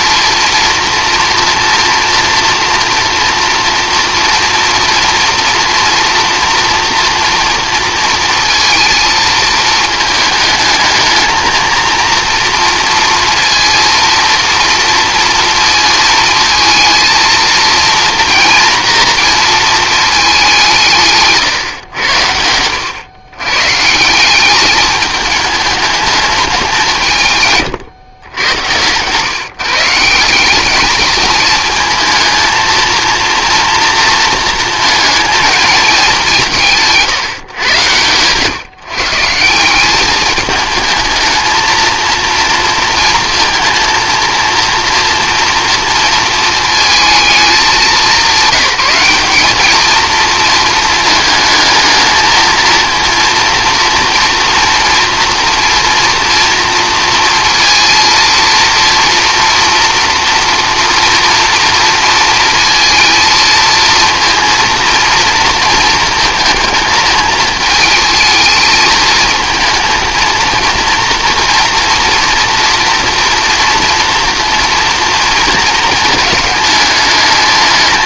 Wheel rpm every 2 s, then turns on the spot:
230, 230, 240, 230, 230, 220, 240, 230, 220, 230, 170, 90, 210, 190, 110, 200, 230, 220, 170, 140, 210, 230, 230, 220, 190, 220, 220, 230, 230, 230, 230, 230, 230, 220, 220, 230, 230, 230, 210.
none